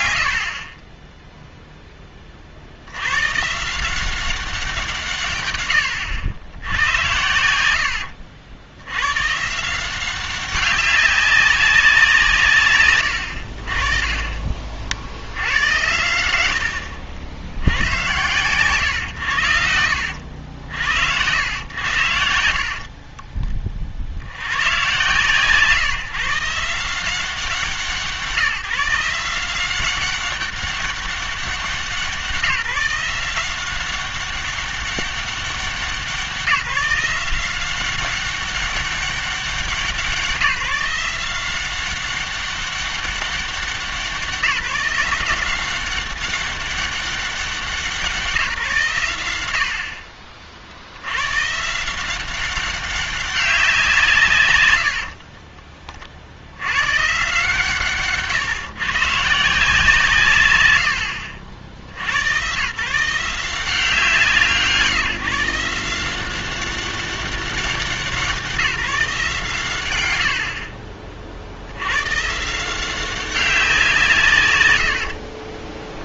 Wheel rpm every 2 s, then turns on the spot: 80, 60, 180, 110, 80, 190, 150, 40, 90, 120, 70, 50, 120, 160, 170, 200, 180, 190, 170, 200, 180, 200, 180, 200, 140, 60, 190, 110, 110, 130, 110, 130, 160, 190, 170, 30, 160, 120.
0-2 22-24